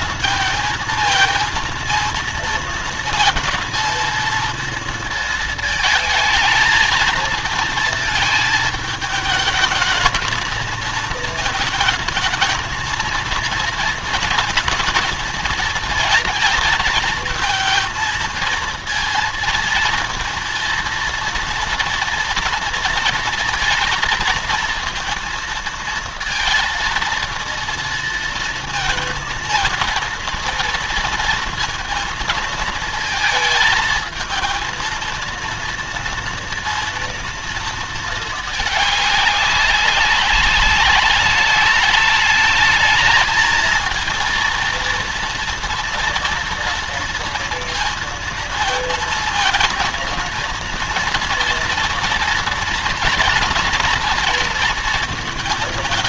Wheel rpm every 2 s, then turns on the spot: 230, 220, 230, 220, 220, 220, 230, 220, 230, 230, 230, 230, 230, 230, 230, 230, 230, 230, 230, 210, 200, 220, 230, 230, 230, 230, 230, 230.
none